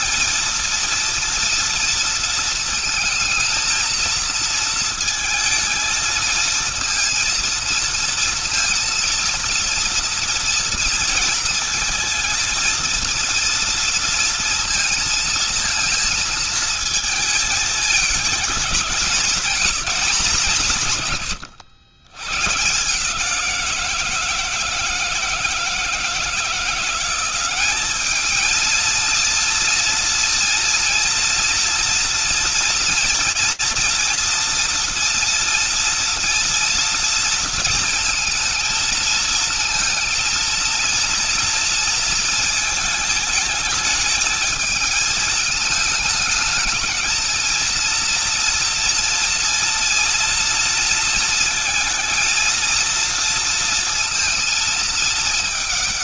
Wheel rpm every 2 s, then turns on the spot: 230, 230, 230, 230, 230, 230, 230, 230, 220, 200, 170, 140, 170, 170, 220, 230, 230, 230, 230, 230, 230, 220, 220, 220, 230, 230, 230, 230.
none